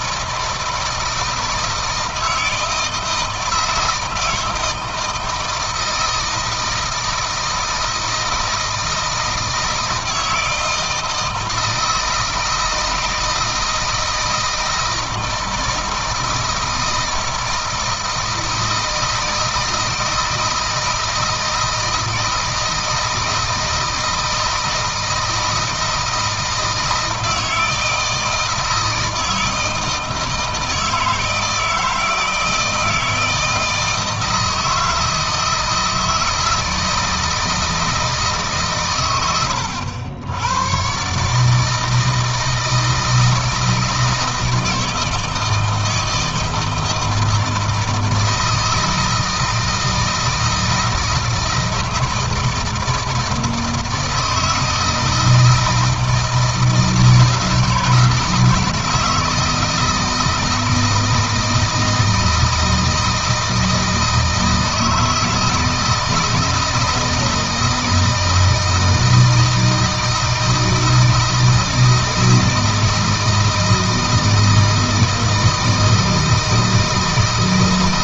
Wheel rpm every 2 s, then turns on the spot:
160, 160, 160, 160, 160, 160, 160, 160, 160, 160, 160, 160, 160, 160, 160, 160, 160, 160, 160, 130, 110, 160, 160, 160, 160, 160, 160, 160, 160, 170, 160, 160, 160, 160, 160, 160, 160, 160, 160.
none